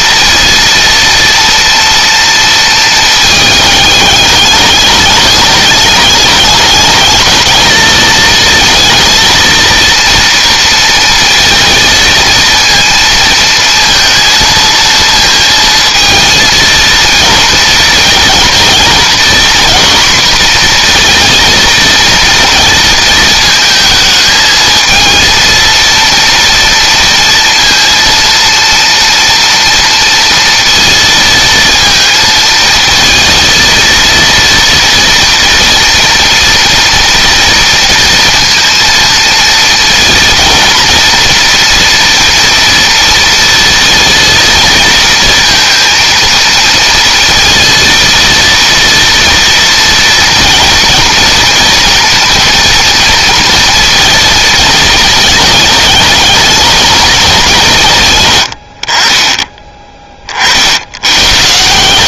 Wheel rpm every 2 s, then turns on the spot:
230, 220, 210, 210, 220, 230, 230, 230, 230, 230, 240, 220, 230, 230, 230, 230, 230, 240, 230, 230, 230, 230, 230, 230, 230, 230, 230, 220, 210, 50, 80.
none